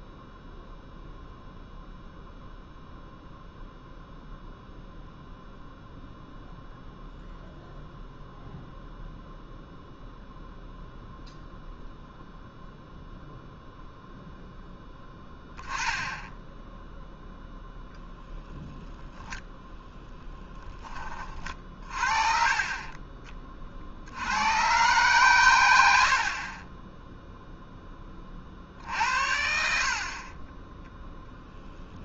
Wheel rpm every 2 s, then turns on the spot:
0, 0, 0, 0, 0, 0, 0, 0, 10, 0, 10, 30, 110, 30, 40, 10.
none